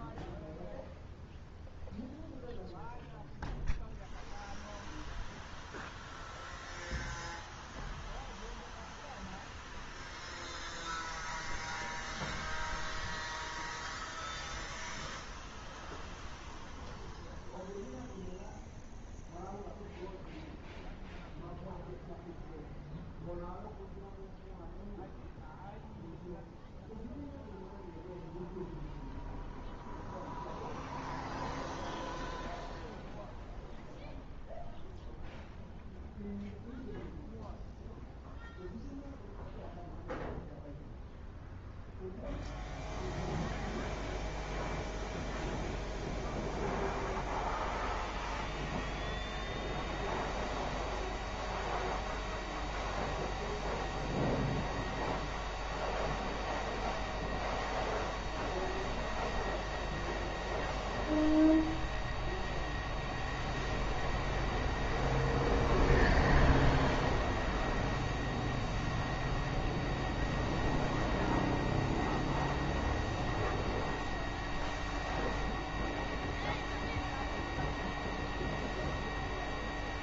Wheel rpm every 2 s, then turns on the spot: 0, 0, 0, 0, 0, 0, 0, 0, 0, 0, 0, 0, 0, 0, 0, 0, 0, 0, 0, 0, 0, 0, 0, 0, 0, 0, 0, 0, 0, 0, 0, 0, 0, 0, 0, 0, 0, 0, 0, 0.
none